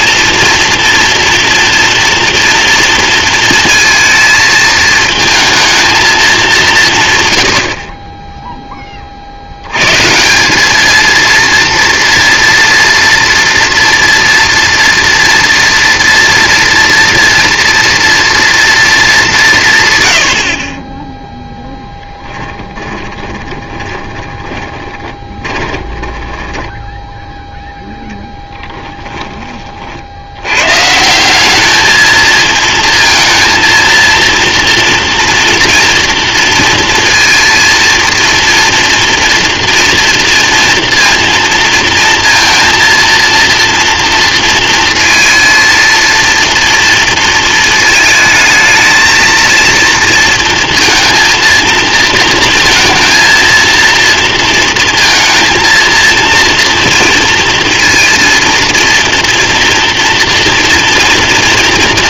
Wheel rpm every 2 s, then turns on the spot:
230, 230, 220, 190, 10, 200, 230, 230, 240, 230, 30, 20, 20, 10, 20, 130, 230, 230, 230, 230, 240, 230, 230, 230, 220, 230, 220, 230, 230, 230, 240.
22-30